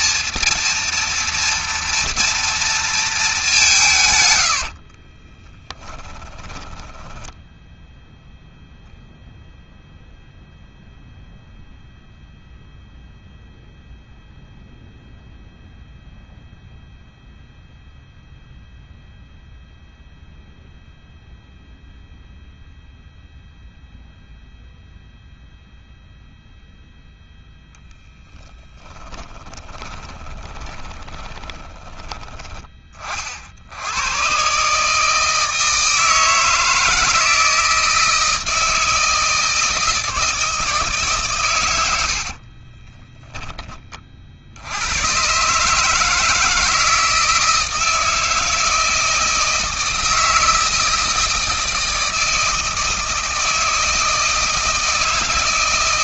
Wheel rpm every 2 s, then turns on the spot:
230, 220, 60, 10, 0, 0, 0, 0, 0, 0, 0, 0, 0, 0, 30, 20, 30, 150, 160, 160, 140, 10, 100, 160, 160, 160, 160, 160.
4-8 28-32 42-44